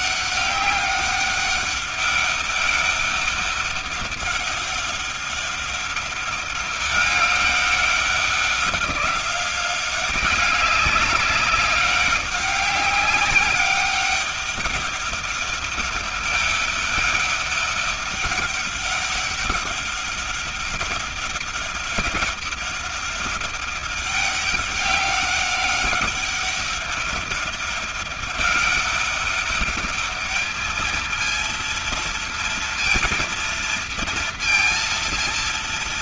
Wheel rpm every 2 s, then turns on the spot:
200, 200, 200, 200, 190, 200, 200, 200, 200, 200, 200, 200, 200, 200, 200, 220, 230, 230.
none